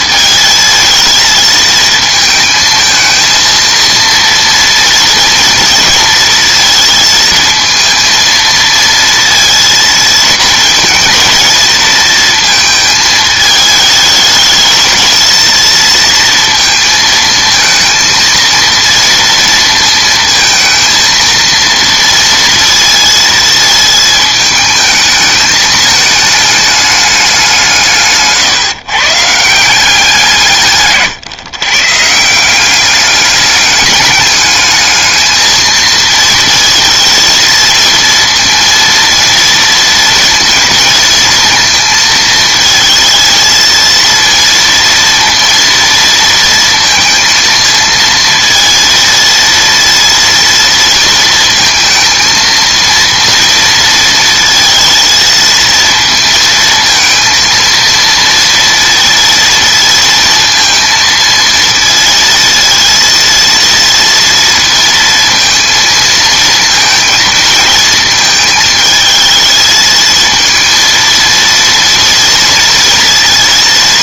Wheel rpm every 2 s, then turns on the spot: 220, 220, 230, 230, 230, 220, 220, 220, 230, 230, 230, 230, 220, 210, 140, 150, 190, 210, 230, 230, 230, 230, 230, 230, 230, 230, 230, 230, 230, 230, 230, 230, 230, 230, 220, 230, 230.
none